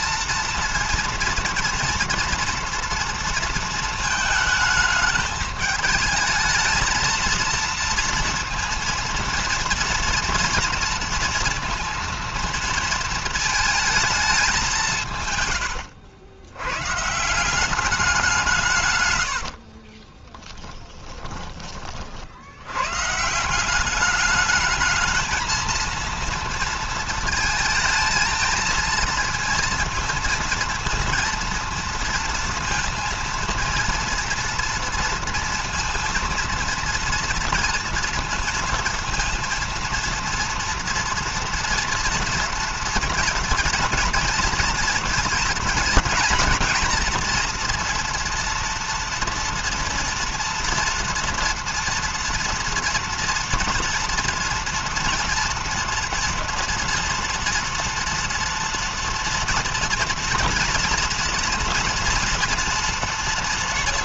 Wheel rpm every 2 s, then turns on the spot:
230, 230, 220, 220, 230, 230, 230, 200, 100, 170, 20, 70, 200, 230, 220, 230, 230, 230, 230, 230, 230, 230, 230, 230, 230, 230, 230, 230, 230, 230, 230, 230.
20-22